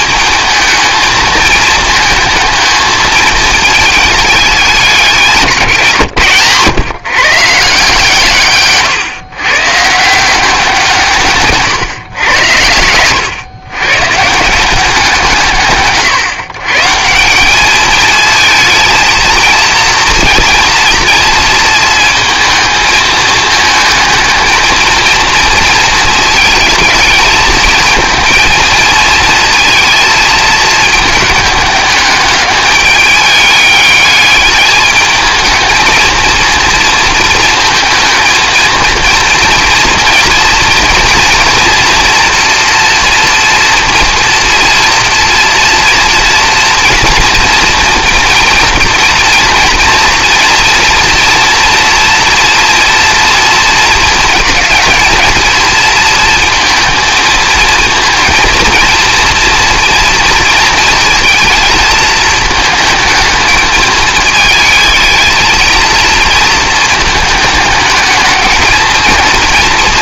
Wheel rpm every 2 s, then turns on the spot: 220, 220, 200, 140, 140, 170, 100, 180, 140, 220, 230, 220, 230, 220, 220, 220, 210, 210, 230, 230, 230, 230, 230, 240, 230, 230, 230, 220, 230, 230, 230, 220, 220, 220, 220.
12-14